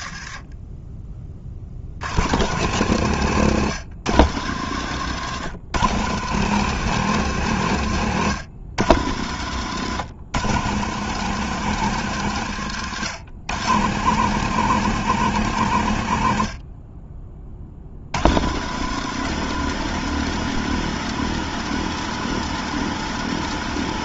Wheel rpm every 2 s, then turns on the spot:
20, 120, 110, 140, 110, 130, 110, 140, 40, 130, 140, 140.
none